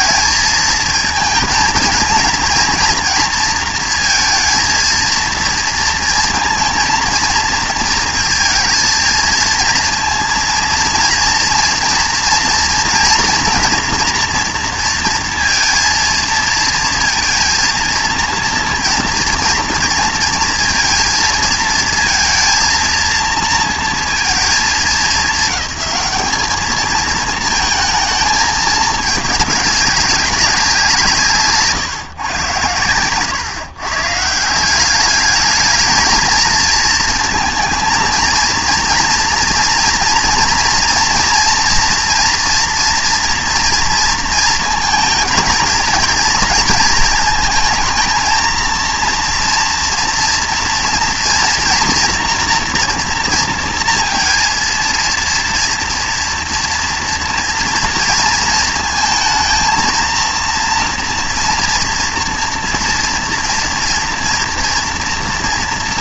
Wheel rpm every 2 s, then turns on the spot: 230, 230, 230, 230, 230, 230, 230, 230, 230, 230, 230, 230, 220, 220, 210, 180, 110, 180, 230, 230, 240, 230, 230, 230, 230, 230, 240, 230, 230, 230, 230, 240, 240.
none